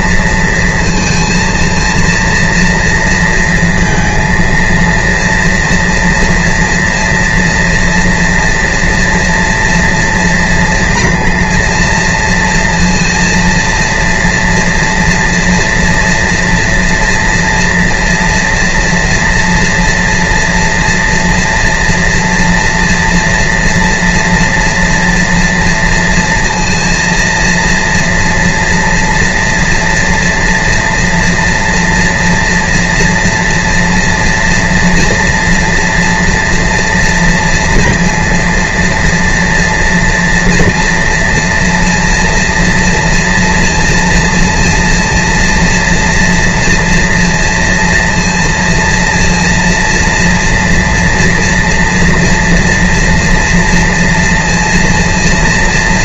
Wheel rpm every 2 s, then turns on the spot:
230, 230, 230, 230, 230, 230, 230, 230, 240, 240, 240, 230, 230, 230, 230, 230, 230, 230, 230, 230, 230, 230, 230, 230, 230, 230, 240, 230.
none